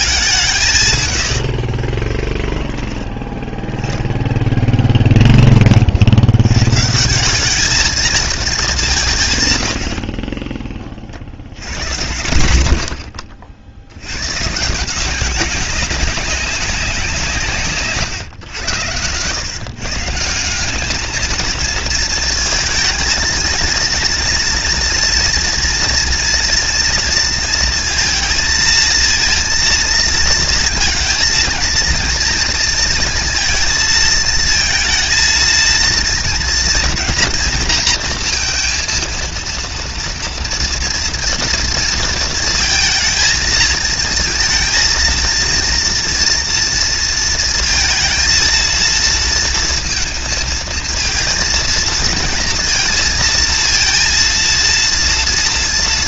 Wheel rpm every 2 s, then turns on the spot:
120, 10, 20, 170, 170, 60, 70, 180, 180, 110, 210, 220, 230, 230, 230, 230, 230, 230, 230, 230, 230, 230, 230, 230, 230, 230, 230, 230.
none